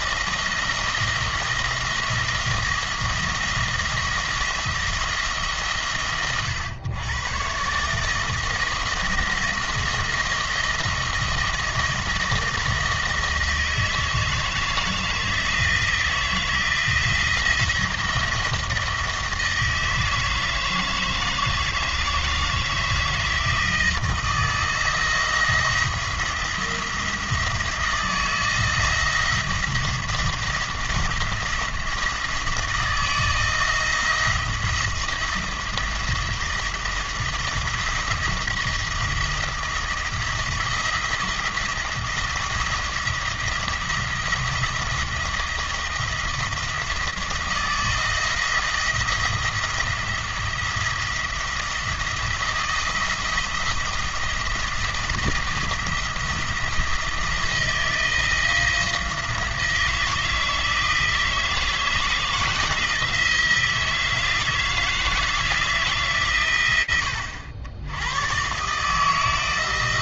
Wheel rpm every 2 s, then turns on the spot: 170, 170, 170, 110, 170, 170, 170, 160, 170, 160, 160, 160, 170, 170, 160, 170, 160, 170, 170, 170, 170, 170, 170, 160, 160, 170, 170, 170, 160, 170, 160, 160, 170, 100, 150.
none